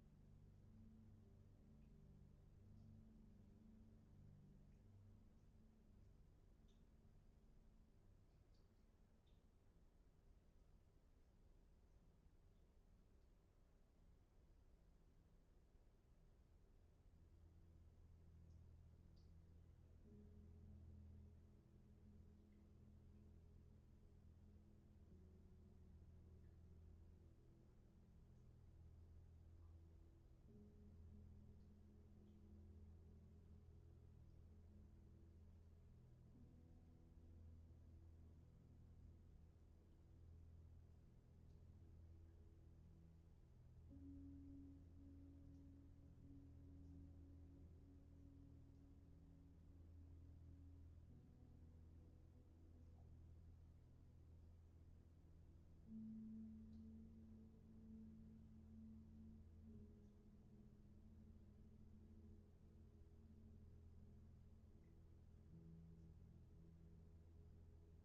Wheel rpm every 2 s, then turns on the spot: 0, 0, 0, 0, 0, 0, 0, 0, 0, 0, 0, 0, 0, 0, 0, 0, 0, 0, 0, 0, 0, 0, 0, 0, 0, 0, 0, 0, 0, 0, 0, 0, 0, 0.
none